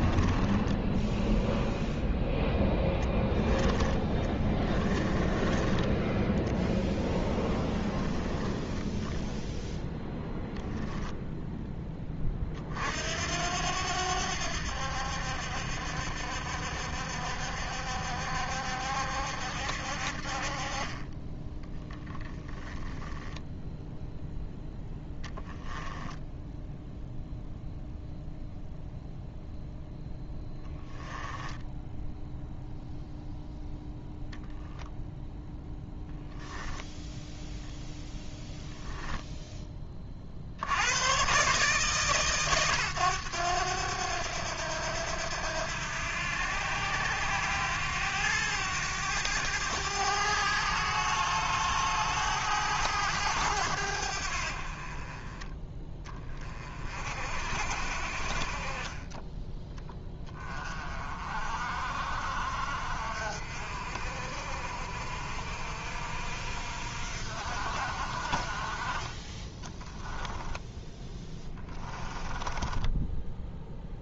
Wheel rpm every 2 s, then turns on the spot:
10, 10, 20, 10, 0, 0, 60, 70, 70, 70, 30, 10, 10, 0, 0, 10, 0, 0, 0, 0, 90, 120, 80, 90, 100, 100, 100, 40, 40, 30, 30, 50, 60, 60, 30, 10, 10.
4-8 22-24 30-32 70-74